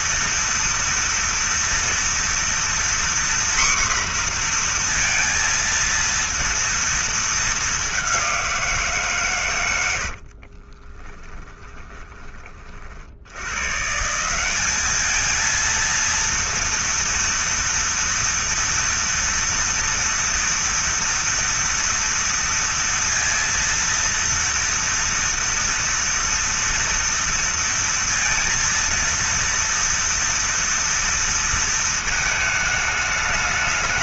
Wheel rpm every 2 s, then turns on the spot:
230, 240, 240, 230, 180, 30, 40, 200, 230, 230, 240, 230, 230, 230, 230, 230, 220.
10-12